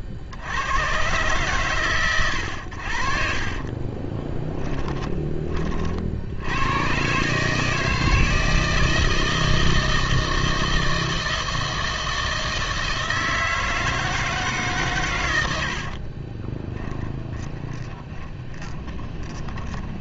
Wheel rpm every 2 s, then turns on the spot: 60, 80, 10, 110, 160, 160, 160, 150, 20, 20.
4-6 16-20